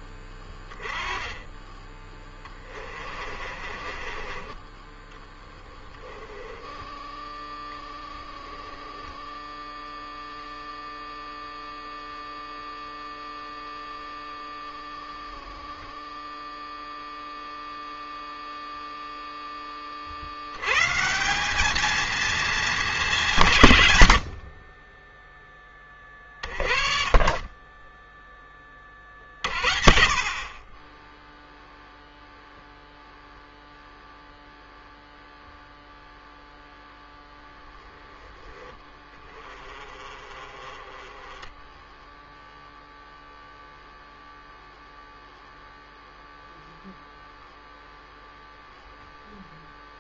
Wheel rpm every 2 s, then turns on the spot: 20, 30, 20, 20, 0, 0, 0, 0, 0, 0, 90, 220, 60, 30, 20, 30, 0, 0, 0, 10, 30, 0, 0, 0, 0.
0-4 6-8 24-26